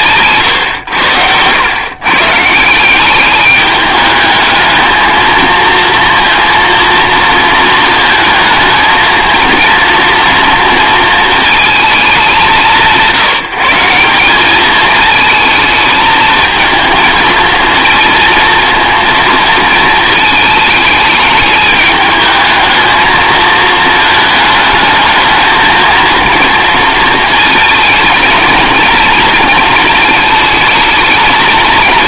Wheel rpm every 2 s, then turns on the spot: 130, 160, 220, 230, 220, 240, 180, 210, 220, 230, 220, 220, 220, 230, 230, 220.
none